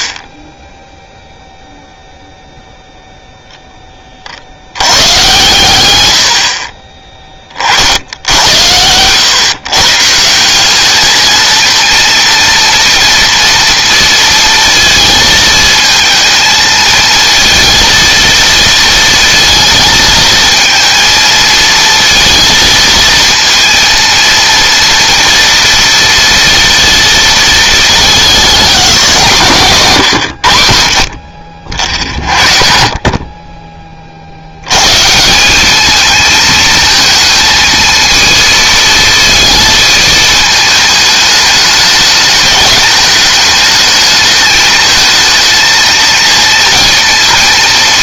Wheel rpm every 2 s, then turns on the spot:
40, 0, 80, 50, 100, 200, 230, 230, 220, 230, 220, 230, 230, 230, 200, 80, 50, 150, 230, 230, 210, 210, 220, 230.
none